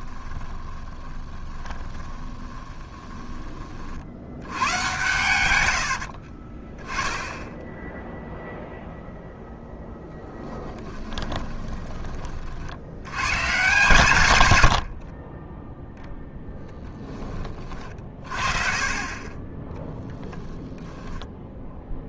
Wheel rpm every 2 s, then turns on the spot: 20, 10, 110, 20, 0, 10, 70, 60, 10, 40, 10.
0-4 10-12 20-22